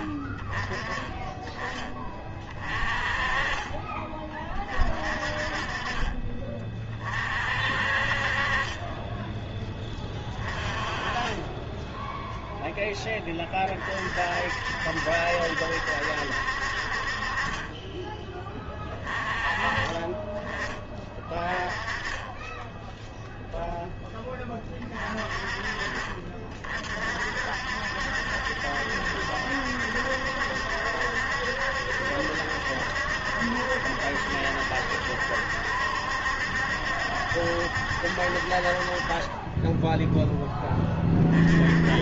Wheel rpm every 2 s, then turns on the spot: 20, 30, 40, 30, 20, 20, 10, 60, 50, 20, 20, 10, 30, 50, 70, 70, 70, 70, 70, 40, 20.
none